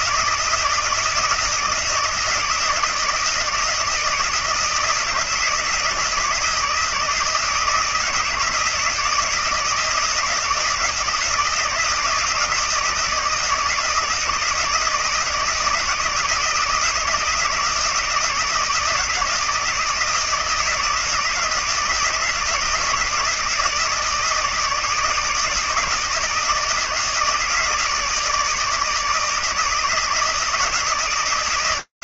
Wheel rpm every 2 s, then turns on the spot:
170, 160, 160, 160, 160, 160, 160, 160, 160, 160, 160, 160, 150, 160, 160, 160.
none